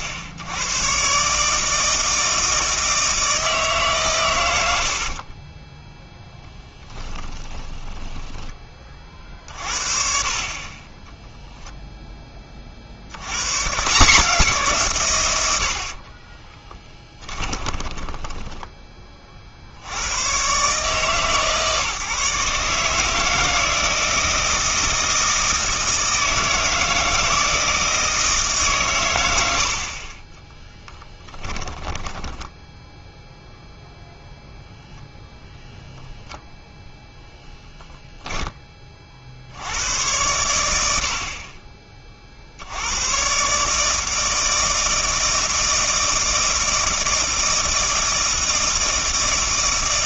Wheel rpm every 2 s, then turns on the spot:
110, 160, 80, 10, 30, 20, 50, 150, 10, 20, 150, 150, 170, 160, 130, 10, 0, 0, 0, 20, 80, 90, 160, 160, 160.
6-8 16-20 30-32